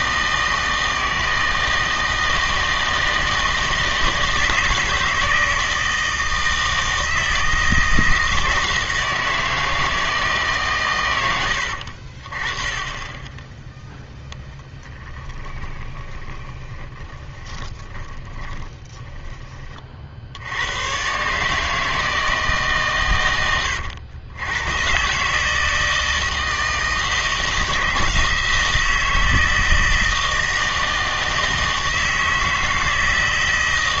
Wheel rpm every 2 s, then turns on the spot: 160, 160, 160, 160, 160, 130, 20, 10, 10, 10, 100, 140, 120, 160, 160, 160, 160.
16-20